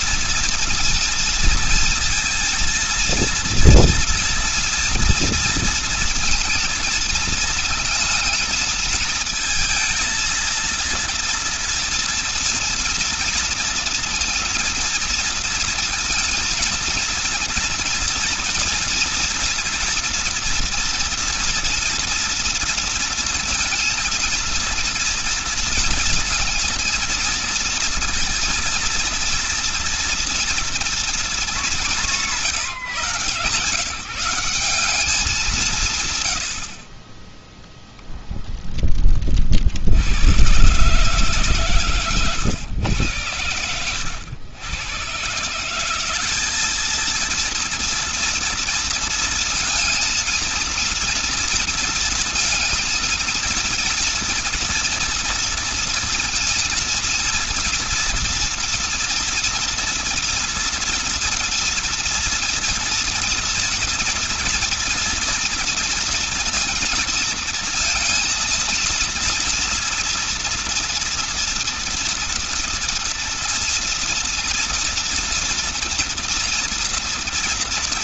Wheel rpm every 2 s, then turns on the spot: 230, 230, 230, 230, 220, 230, 230, 240, 230, 230, 230, 230, 230, 230, 230, 230, 160, 190, 50, 10, 140, 110, 120, 220, 230, 230, 230, 230, 230, 230, 230, 230, 240, 230, 230, 230, 230, 230, 240.
none